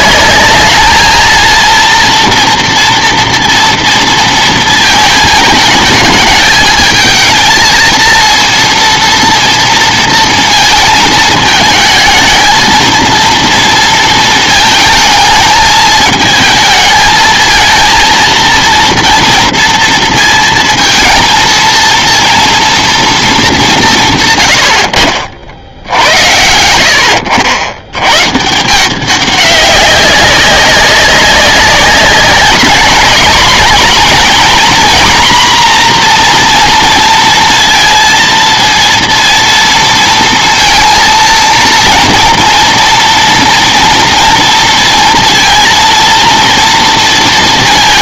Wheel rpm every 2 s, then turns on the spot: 210, 230, 230, 220, 230, 230, 220, 220, 220, 230, 230, 240, 100, 80, 160, 190, 200, 240, 240, 230, 230, 230, 230, 230.
none